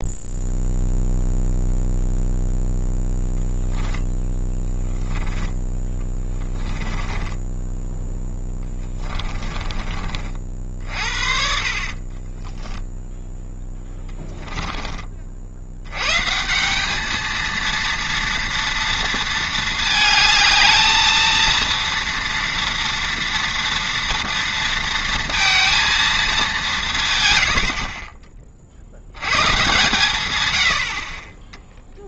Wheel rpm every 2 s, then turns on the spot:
0, 0, 10, 20, 10, 50, 10, 30, 200, 230, 220, 230, 230, 160, 50, 80.
4-10 12-14